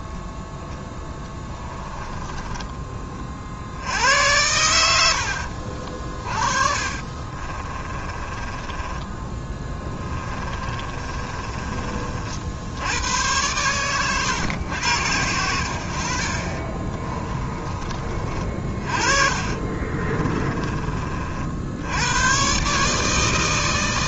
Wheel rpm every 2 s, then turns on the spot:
0, 20, 90, 30, 20, 30, 70, 100, 30, 40, 20, 140.
2-4 6-12 16-18